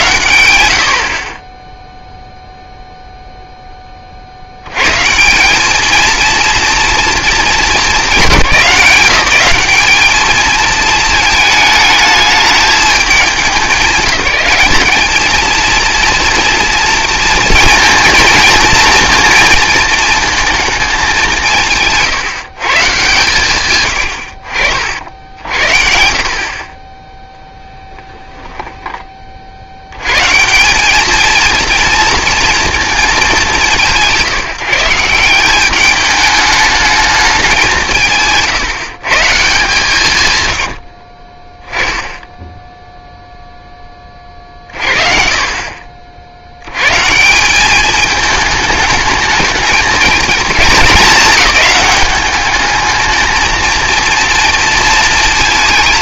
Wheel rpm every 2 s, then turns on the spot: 80, 0, 80, 230, 190, 220, 210, 210, 230, 230, 220, 130, 60, 30, 10, 190, 230, 160, 210, 170, 80, 0, 40, 100, 210, 230, 210, 230.
none